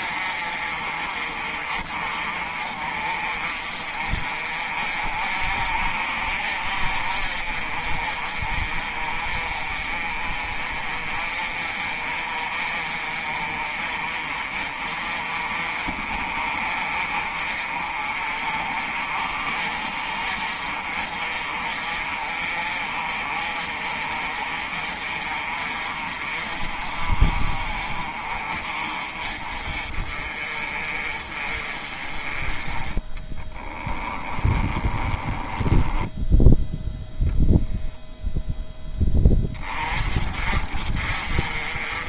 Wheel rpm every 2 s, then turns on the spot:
40, 40, 40, 40, 40, 40, 40, 40, 40, 40, 40, 40, 40, 40, 40, 40, 20, 20, 0, 10, 40.
34-36